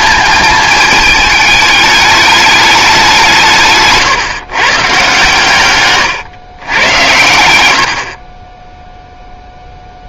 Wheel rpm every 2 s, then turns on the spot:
220, 210, 140, 110, 10.
none